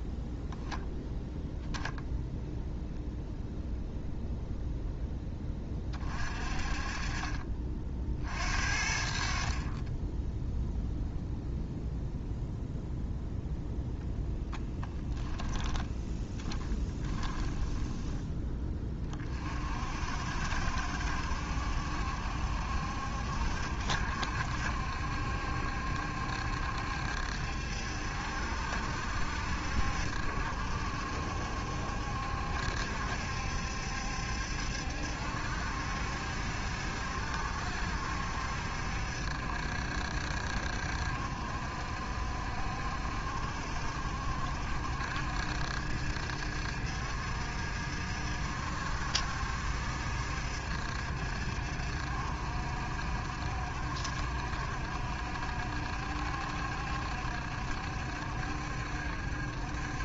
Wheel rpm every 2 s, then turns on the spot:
10, 0, 0, 40, 60, 0, 0, 0, 10, 10, 60, 70, 70, 70, 70, 70, 70, 70, 60, 60, 60, 60, 60, 60, 60, 60, 60, 60, 60, 60.
16-18